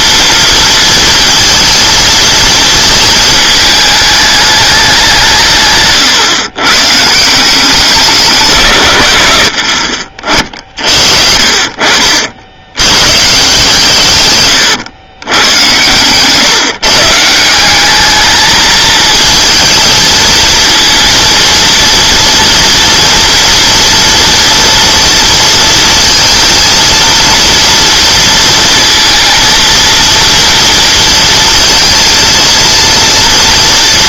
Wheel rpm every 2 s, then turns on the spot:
230, 230, 210, 130, 150, 50, 80, 120, 140, 220, 230, 230, 230, 230, 230, 230, 230.
10-12 14-16